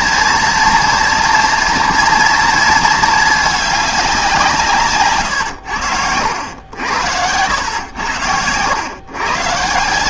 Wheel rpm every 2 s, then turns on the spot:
230, 230, 150, 80, 100.
none